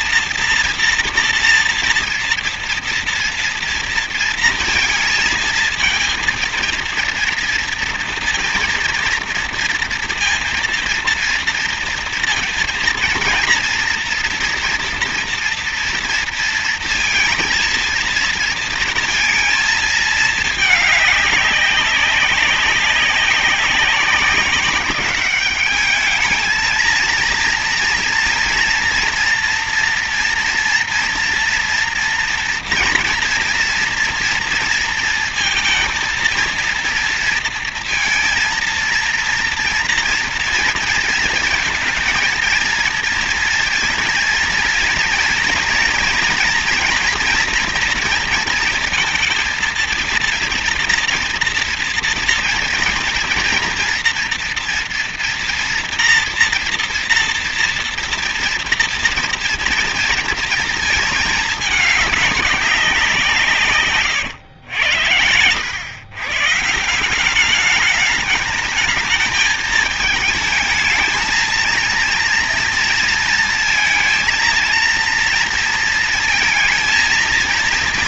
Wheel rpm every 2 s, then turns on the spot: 230, 230, 230, 230, 230, 230, 230, 230, 230, 230, 210, 200, 200, 230, 230, 240, 230, 230, 230, 230, 230, 230, 230, 240, 230, 230, 230, 230, 230, 240, 220, 190, 100, 160, 220, 220, 230, 230, 230.
none